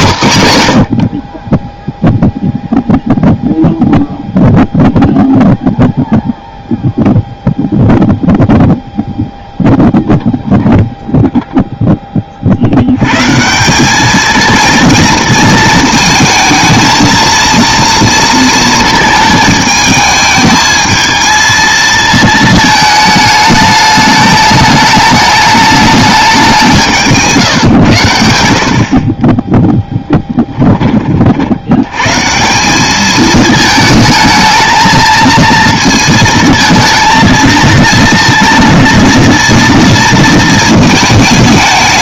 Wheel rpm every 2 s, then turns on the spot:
110, 0, 0, 0, 0, 0, 80, 220, 220, 220, 220, 220, 210, 180, 60, 20, 190, 220, 220, 230, 220.
none